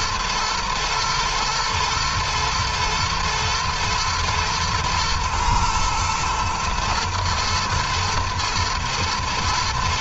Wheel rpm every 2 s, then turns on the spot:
110, 120, 110, 120, 120.
none